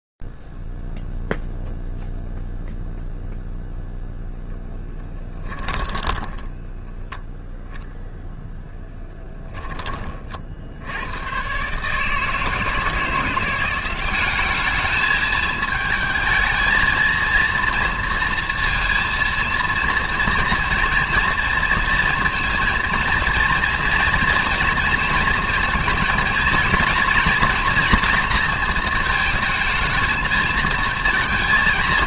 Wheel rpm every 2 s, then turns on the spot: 0, 0, 0, 10, 0, 30, 150, 190, 220, 230, 230, 230, 230, 230, 230, 220.
6-8